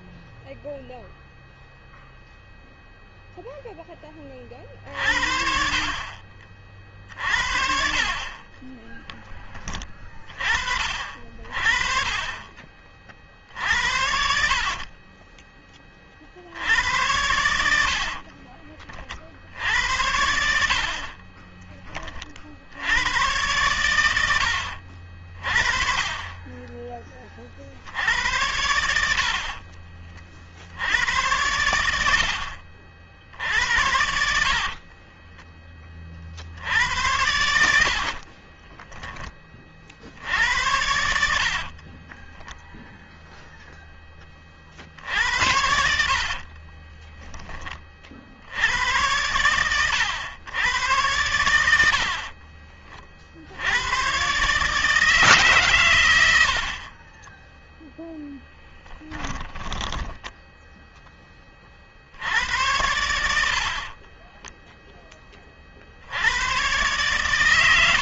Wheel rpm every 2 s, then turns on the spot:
0, 0, 50, 50, 20, 40, 50, 20, 90, 50, 40, 90, 60, 20, 70, 80, 50, 30, 70, 20, 80, 0, 50, 20, 90, 100, 30, 140, 70, 0, 10, 80, 20, 100.
12-16 20-22 34-36 38-40 46-48 56-58 64-66